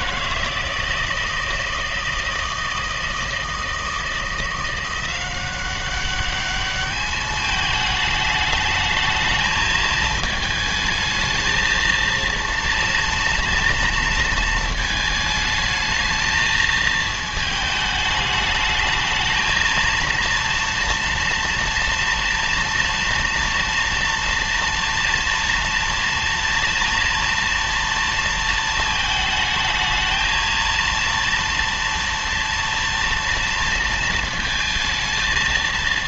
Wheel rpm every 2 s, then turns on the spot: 160, 160, 170, 200, 220, 220, 230, 220, 220, 220, 230, 240, 240, 240, 230, 230, 230, 230.
none